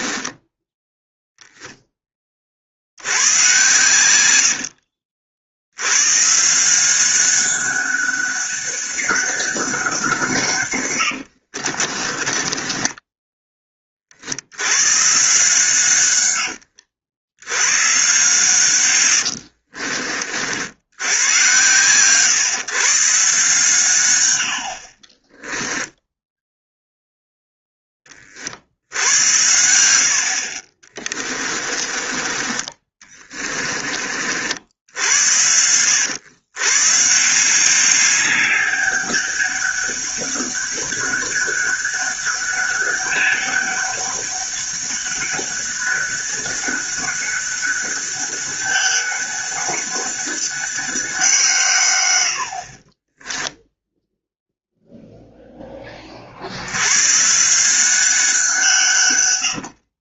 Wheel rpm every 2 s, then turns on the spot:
10, 70, 60, 180, 200, 110, 20, 110, 70, 100, 80, 140, 60, 0, 70, 40, 30, 70, 140, 200, 200, 200, 200, 200, 200, 190, 40, 0, 110, 140.
0-2 4-6 10-14 18-20 30-34 52-54